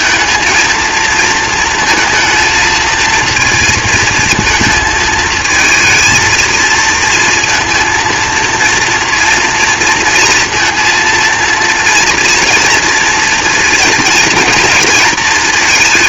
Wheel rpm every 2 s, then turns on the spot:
220, 230, 230, 230, 230, 230, 230, 230.
none